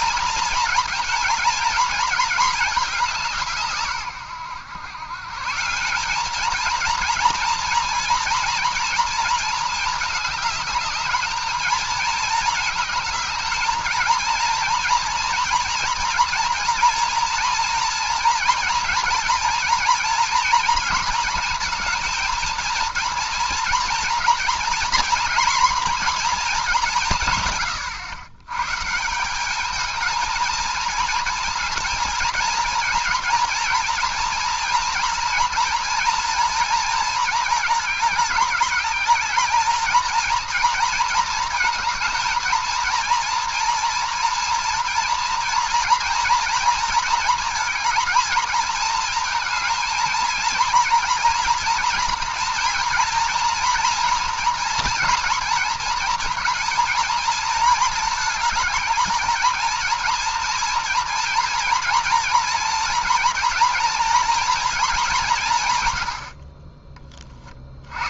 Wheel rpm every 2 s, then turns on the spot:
240, 220, 110, 220, 230, 210, 220, 230, 230, 230, 240, 230, 240, 210, 120, 230, 230, 240, 230, 200, 230, 230, 230, 230, 230, 230, 240, 230, 230, 220, 230, 230, 230, 50.
none